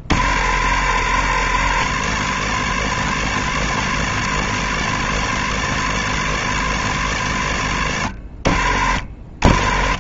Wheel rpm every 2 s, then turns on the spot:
40, 70, 70, 80, 40.
none